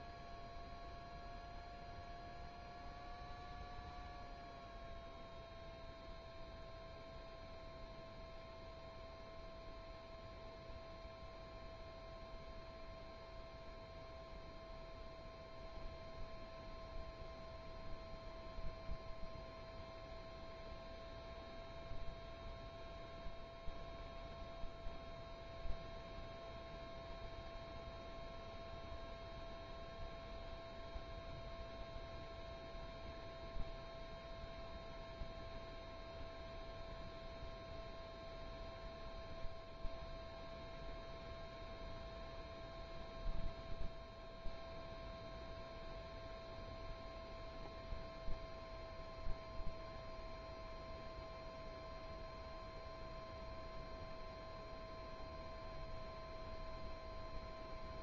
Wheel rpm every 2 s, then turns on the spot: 0, 0, 0, 0, 0, 0, 0, 0, 0, 0, 0, 0, 0, 0, 0, 0, 0, 0, 0, 0, 0, 0, 0, 0, 0, 0, 0, 0, 0.
none